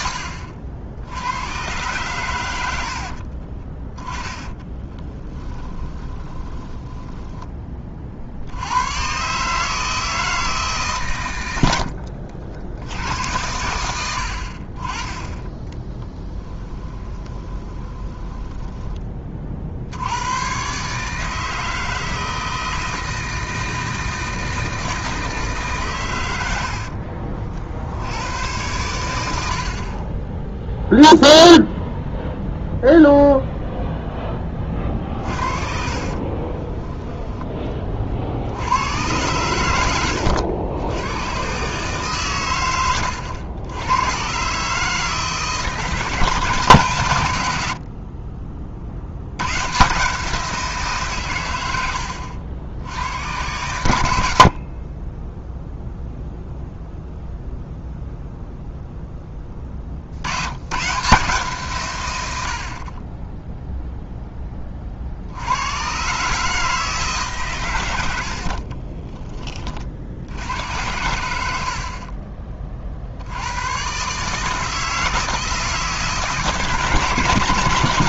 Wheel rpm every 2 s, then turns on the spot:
70, 70, 10, 10, 100, 140, 80, 40, 10, 20, 140, 160, 160, 60, 100, 0, 0, 30, 20, 90, 90, 100, 150, 150, 50, 160, 80, 30, 0, 0, 130, 40, 30, 150, 50, 90, 40, 160, 150.
2-8 16-18 26-28 36-38 68-70